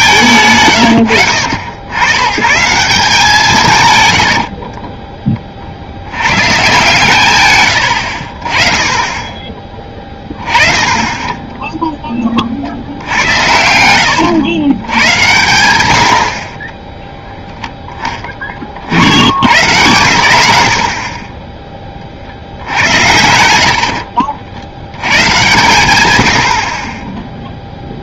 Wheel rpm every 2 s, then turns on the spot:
120, 150, 50, 140, 30, 30, 60, 110, 30, 40, 70, 80, 80, 40.
4-6